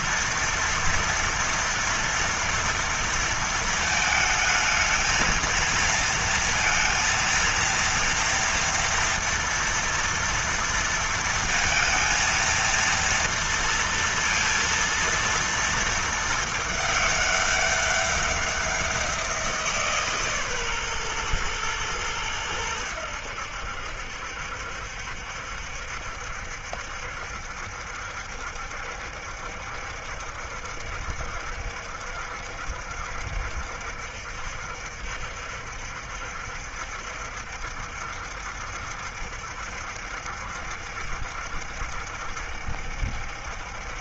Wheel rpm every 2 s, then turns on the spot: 230, 230, 220, 230, 240, 230, 230, 230, 210, 190, 130, 100, 70, 70, 70, 70, 70, 70, 70, 70, 70, 70.
none